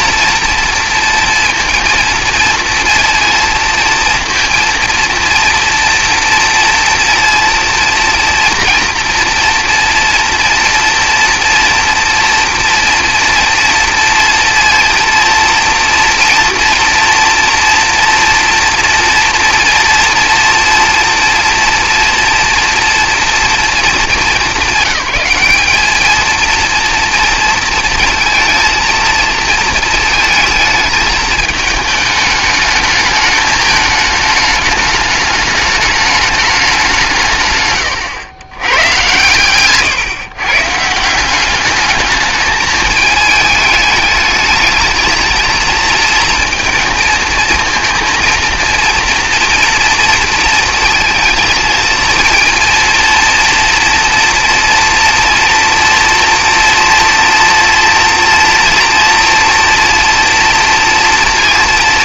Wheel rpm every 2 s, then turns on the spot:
230, 230, 230, 230, 240, 230, 240, 230, 230, 230, 230, 240, 200, 230, 230, 220, 210, 210, 180, 120, 150, 210, 220, 230, 230, 220, 230, 240, 230, 230, 240.
none